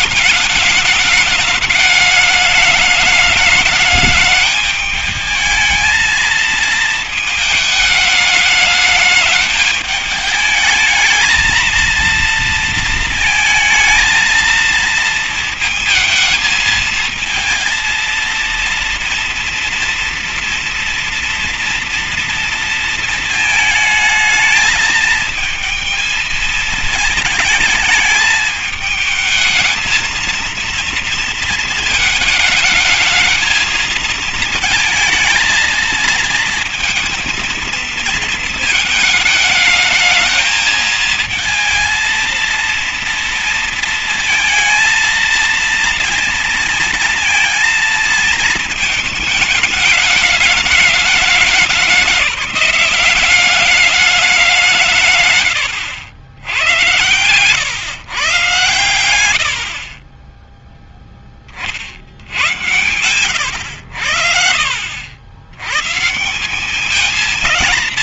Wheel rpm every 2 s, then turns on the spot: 210, 210, 220, 210, 210, 230, 230, 220, 230, 230, 230, 220, 220, 220, 220, 220, 220, 230, 230, 220, 230, 230, 230, 230, 220, 200, 200, 90, 120, 20, 70, 90, 140, 190.
none